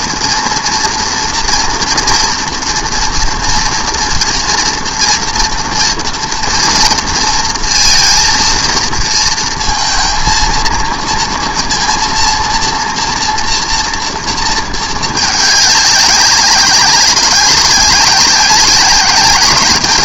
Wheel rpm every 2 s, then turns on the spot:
240, 240, 240, 230, 230, 230, 230, 220, 190, 190.
none